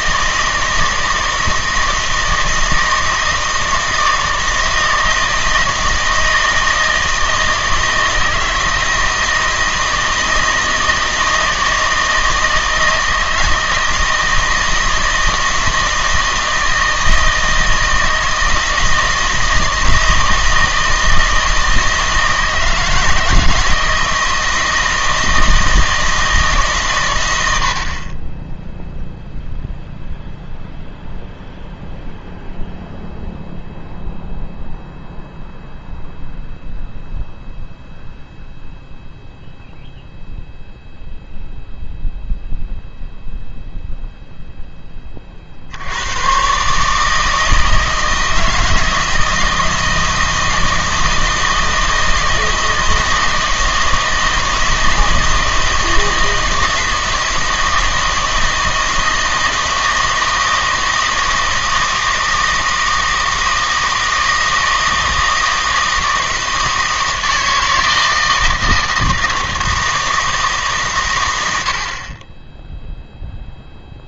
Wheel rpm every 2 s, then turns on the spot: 160, 160, 160, 160, 160, 160, 160, 160, 160, 160, 160, 160, 160, 140, 0, 0, 0, 0, 0, 0, 0, 0, 10, 130, 160, 160, 160, 160, 160, 160, 160, 160, 160, 160, 160, 150, 10.
none